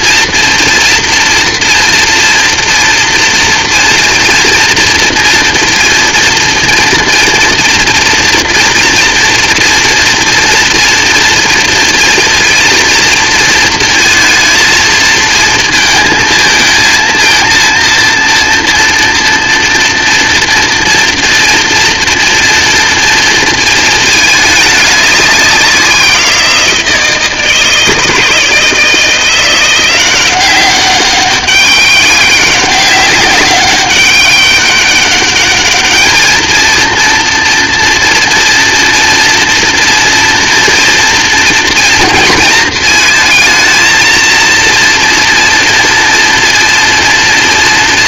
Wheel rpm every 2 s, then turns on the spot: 230, 230, 230, 230, 230, 240, 230, 220, 220, 230, 230, 240, 200, 170, 170, 200, 190, 200, 230, 230, 230, 230, 230, 240.
none